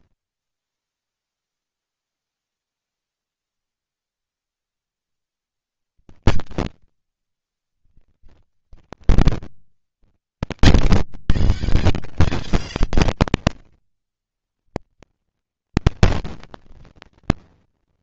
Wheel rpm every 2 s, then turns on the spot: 20, 10, 30, 80, 120, 140, 150, 130, 210.
8-10